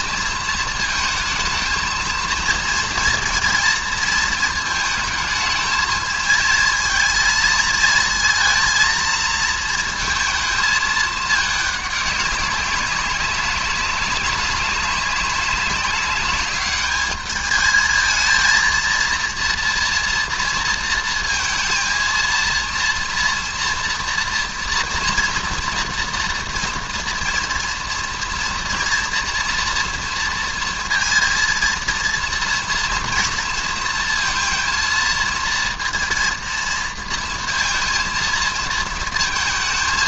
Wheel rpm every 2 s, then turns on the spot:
220, 230, 220, 220, 230, 220, 200, 200, 210, 230, 230, 230, 230, 240, 230, 230, 230, 230, 230, 230.
none